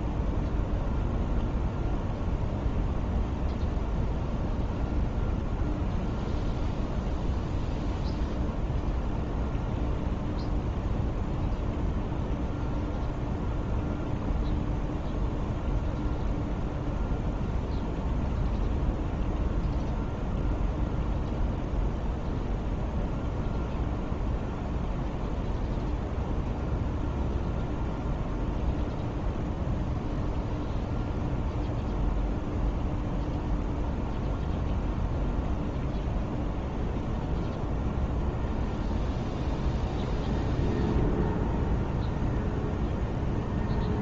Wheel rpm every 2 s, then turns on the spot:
0, 0, 0, 0, 0, 0, 0, 0, 0, 0, 0, 0, 0, 0, 0, 0, 0, 0, 0, 0, 0, 0.
none